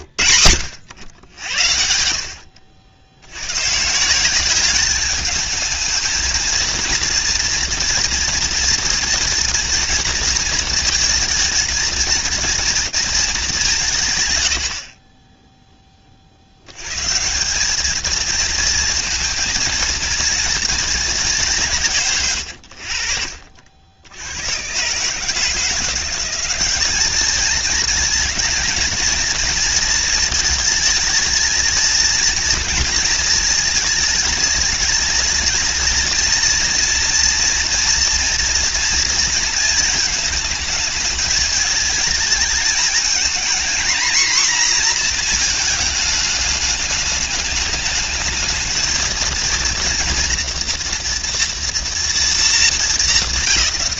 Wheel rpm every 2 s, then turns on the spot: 100, 90, 210, 230, 230, 220, 210, 10, 140, 230, 200, 60, 140, 210, 220, 220, 230, 230, 230, 230, 220, 230, 230, 210, 230, 230, 190.
none